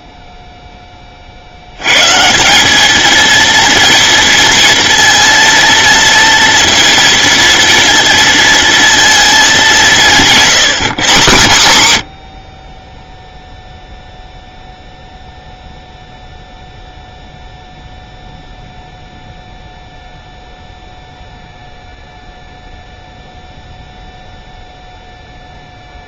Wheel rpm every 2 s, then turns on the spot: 10, 200, 230, 230, 230, 180, 40, 0, 0, 0, 0, 0, 0.
none